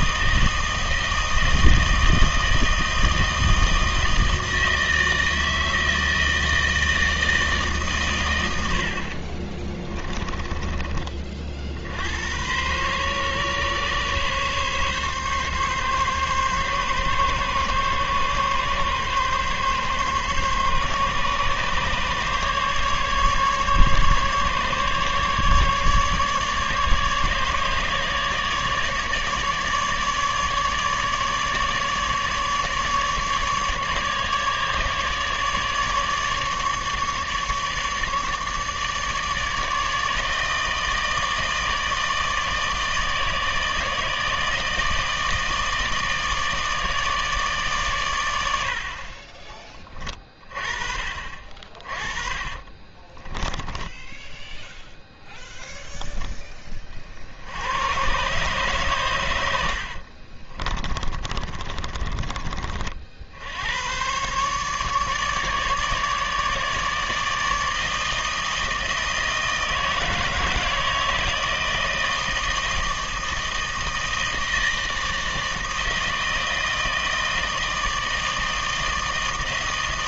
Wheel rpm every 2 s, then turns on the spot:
160, 160, 160, 160, 90, 30, 110, 140, 140, 140, 140, 140, 140, 150, 150, 150, 150, 150, 150, 150, 160, 160, 160, 160, 80, 30, 30, 0, 20, 130, 30, 40, 140, 150, 160, 160, 160, 160, 160, 160.
10-12 52-54 60-62